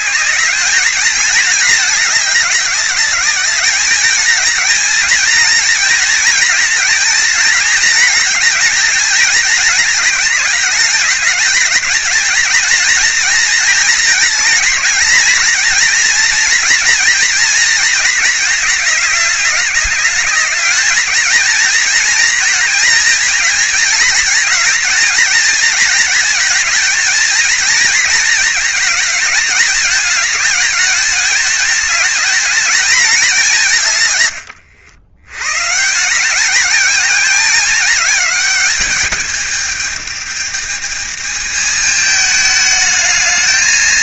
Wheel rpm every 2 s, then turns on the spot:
210, 200, 220, 230, 220, 210, 220, 230, 230, 210, 210, 230, 220, 220, 220, 210, 220, 90, 220, 210, 210, 220.
none